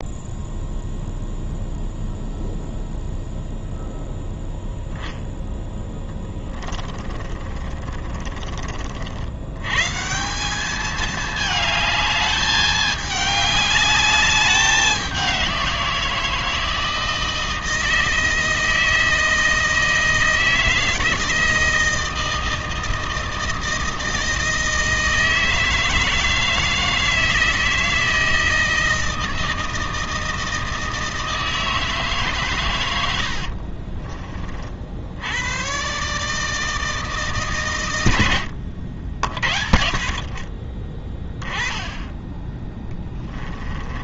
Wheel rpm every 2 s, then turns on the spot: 0, 0, 0, 20, 60, 210, 210, 190, 160, 160, 160, 160, 160, 160, 160, 160, 90, 80, 160, 60, 30, 10.
6-8 42-44